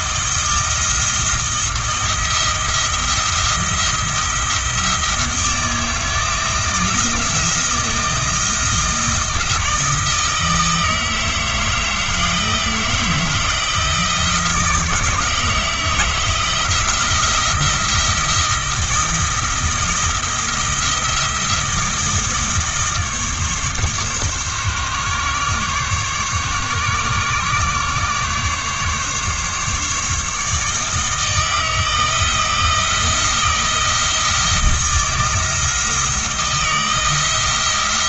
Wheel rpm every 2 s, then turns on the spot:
170, 170, 170, 170, 170, 160, 160, 160, 170, 160, 160, 160, 140, 140, 140, 160, 170, 170, 160.
none